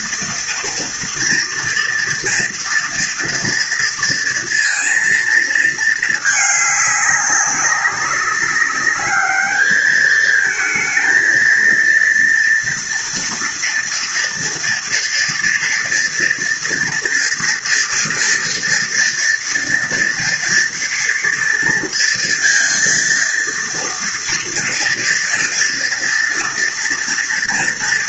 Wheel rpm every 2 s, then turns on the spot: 230, 230, 230, 200, 210, 230, 230, 230, 230, 230, 240, 230, 230, 230.
none